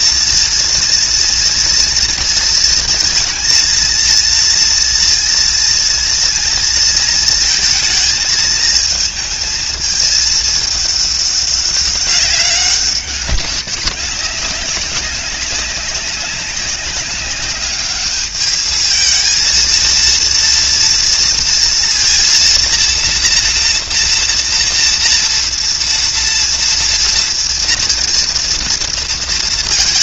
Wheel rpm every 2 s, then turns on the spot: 230, 230, 240, 230, 230, 220, 200, 200, 200, 210, 230, 230, 230, 230, 230.
none